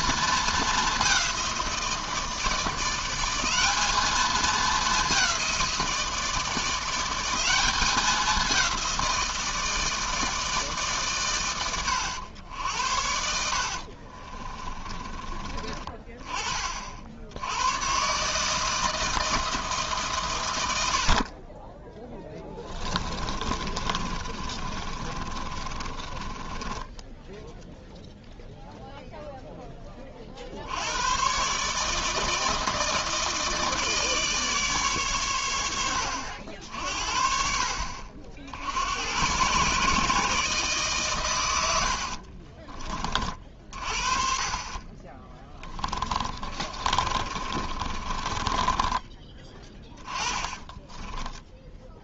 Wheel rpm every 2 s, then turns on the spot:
210, 170, 200, 180, 180, 150, 70, 20, 40, 160, 80, 20, 30, 10, 0, 90, 160, 130, 60, 80, 140, 30, 30, 40, 20, 10.
14-16 22-28 46-52